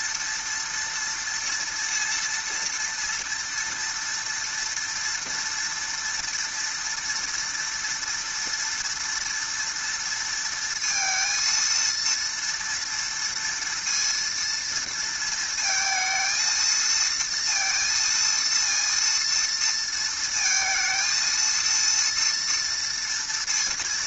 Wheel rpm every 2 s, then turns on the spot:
230, 230, 230, 230, 230, 230, 230, 230, 230, 230, 220, 230.
none